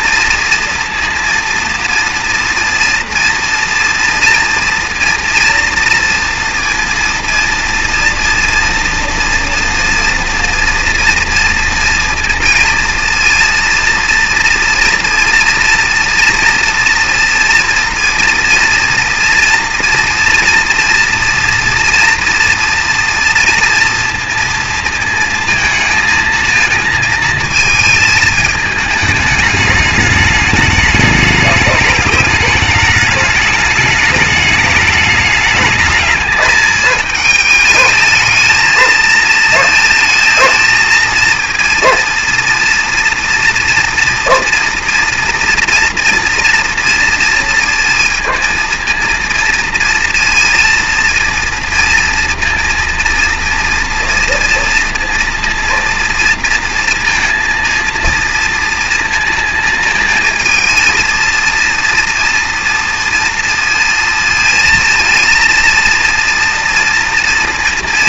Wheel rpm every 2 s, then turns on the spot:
230, 230, 240, 230, 230, 230, 230, 240, 230, 230, 230, 240, 230, 230, 220, 210, 210, 210, 210, 220, 230, 230, 240, 230, 230, 230, 230, 230, 230, 230, 230, 230, 230, 230.
none